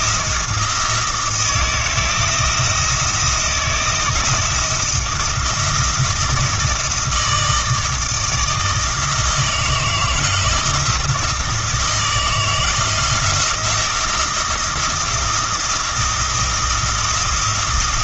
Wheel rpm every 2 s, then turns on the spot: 170, 170, 170, 160, 160, 160, 160, 170, 170.
none